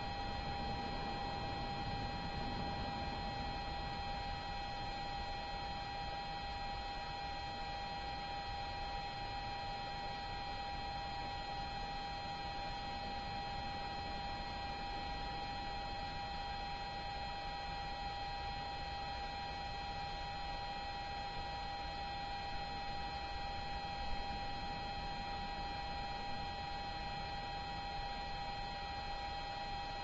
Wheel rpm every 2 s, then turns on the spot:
0, 0, 0, 0, 0, 0, 0, 0, 0, 0, 0, 0, 0, 0, 0.
none